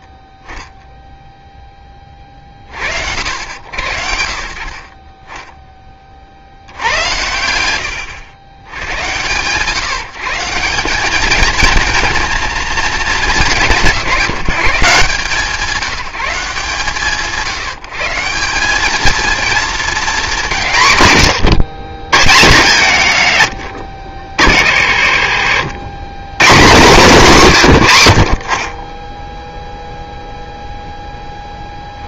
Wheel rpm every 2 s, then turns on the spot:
10, 40, 60, 60, 110, 180, 220, 160, 170, 190, 170, 100, 40, 140, 20, 0.
none